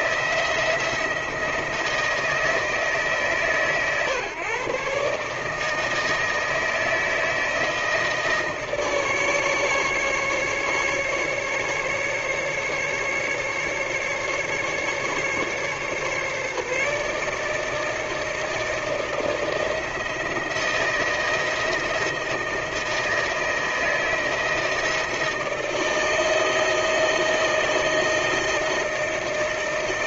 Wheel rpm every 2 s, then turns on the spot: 170, 150, 140, 160, 150, 150, 150, 150, 150, 160, 160, 160, 160, 160, 160.
none